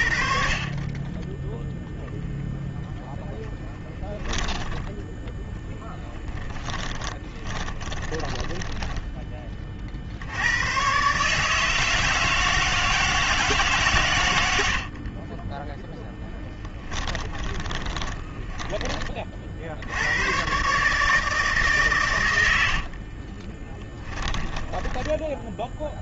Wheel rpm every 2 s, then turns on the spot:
0, 10, 10, 20, 30, 150, 150, 20, 20, 40, 150, 40, 10.
2-8 14-18 22-24